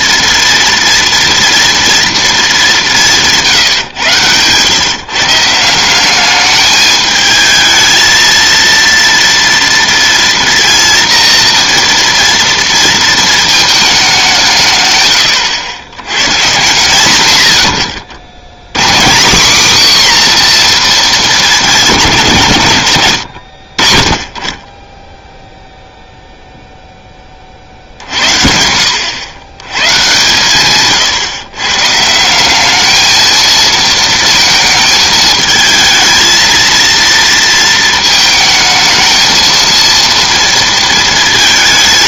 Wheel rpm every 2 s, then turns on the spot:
230, 200, 120, 210, 230, 230, 230, 150, 140, 130, 250, 140, 30, 0, 80, 130, 200, 220, 230, 220, 230.
none